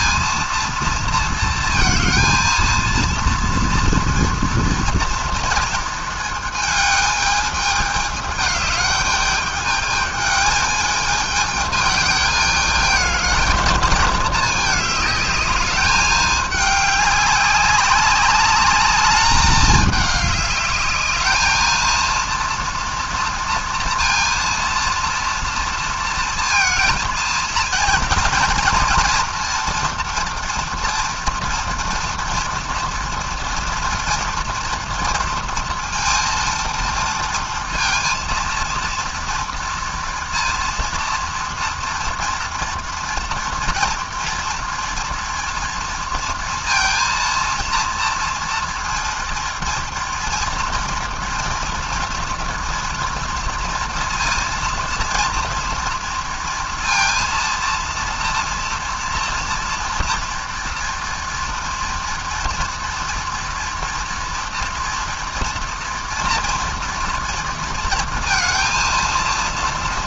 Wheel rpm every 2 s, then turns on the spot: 230, 230, 230, 220, 210, 210, 220, 210, 210, 200, 210, 230, 230, 230, 230, 230, 230, 230, 230, 230, 230, 230, 230, 230, 230, 230, 230, 230, 230, 240, 230, 230, 240, 240, 230.
none